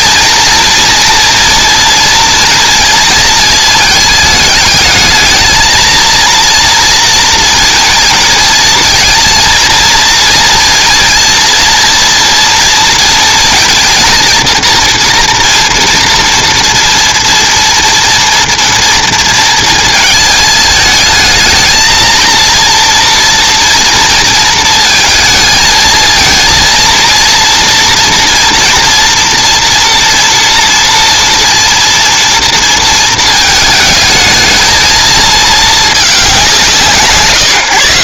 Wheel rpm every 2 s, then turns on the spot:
230, 230, 210, 230, 230, 230, 230, 230, 240, 230, 220, 230, 230, 230, 230, 230, 230, 220, 210.
none